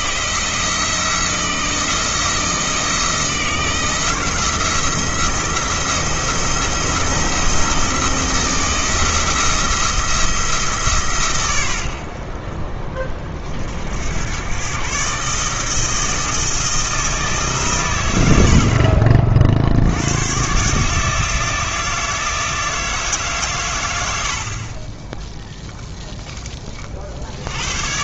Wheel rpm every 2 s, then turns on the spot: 170, 170, 170, 170, 160, 150, 40, 130, 160, 50, 150, 160, 20, 40.
none